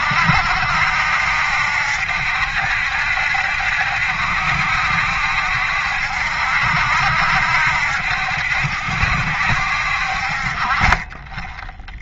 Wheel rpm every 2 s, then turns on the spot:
70, 70, 70, 70, 70, 40.
none